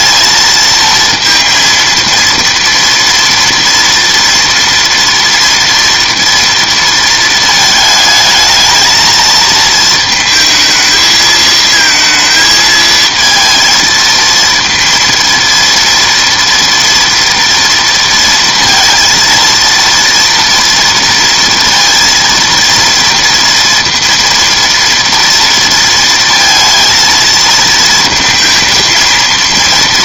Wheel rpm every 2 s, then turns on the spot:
230, 230, 230, 230, 220, 220, 220, 230, 230, 230, 230, 230, 230, 230, 230.
none